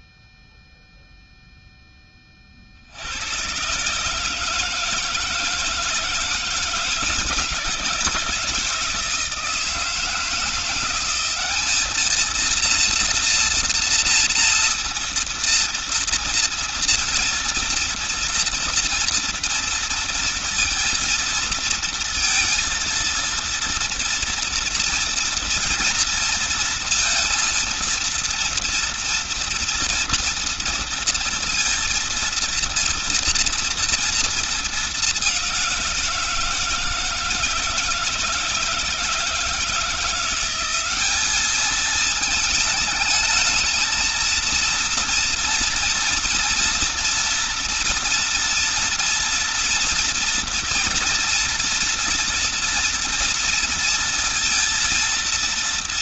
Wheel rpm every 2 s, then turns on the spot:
0, 50, 160, 160, 160, 170, 230, 230, 230, 230, 230, 230, 230, 230, 230, 230, 230, 220, 160, 160, 180, 220, 230, 230, 230, 230, 230, 230.
none